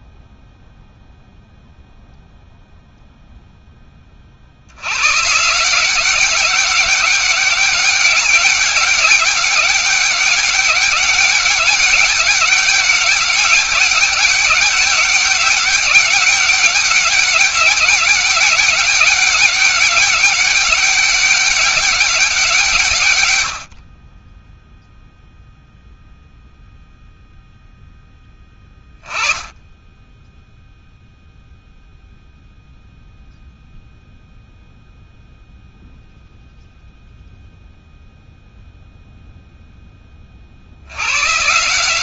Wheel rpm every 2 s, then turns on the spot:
0, 0, 140, 200, 200, 200, 200, 200, 200, 200, 200, 110, 0, 0, 10, 0, 0, 0, 0, 0, 60.
none